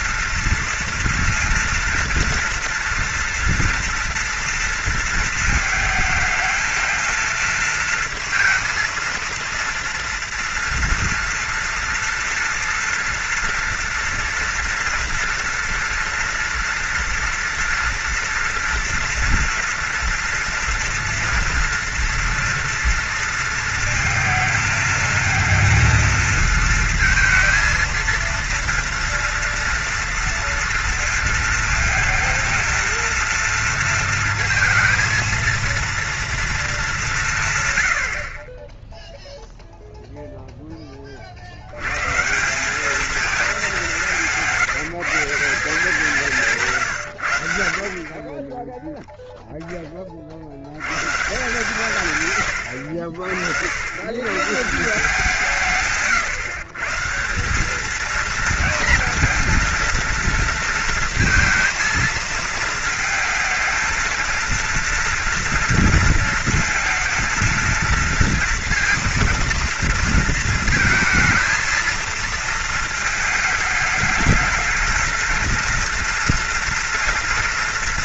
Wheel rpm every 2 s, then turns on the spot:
240, 230, 230, 220, 230, 230, 230, 230, 230, 230, 230, 230, 220, 230, 230, 230, 230, 230, 230, 40, 0, 170, 170, 160, 30, 60, 110, 140, 140, 220, 230, 220, 230, 230, 230, 220, 230, 220, 230.
none